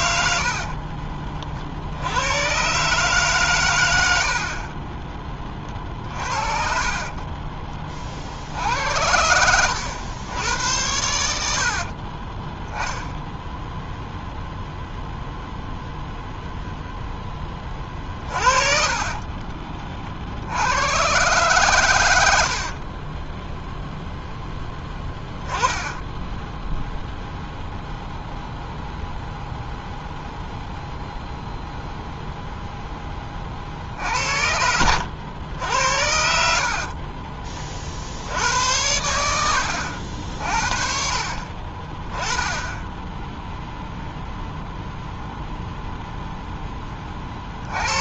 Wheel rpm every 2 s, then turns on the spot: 50, 130, 30, 40, 80, 80, 0, 0, 0, 40, 100, 60, 10, 0, 0, 0, 0, 80, 60, 90, 50, 10, 0, 10.
0-2 6-8 18-20 22-26 36-38